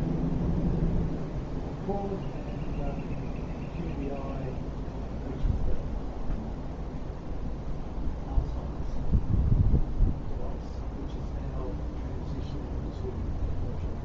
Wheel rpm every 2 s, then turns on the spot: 0, 0, 0, 0, 0, 0, 0.
none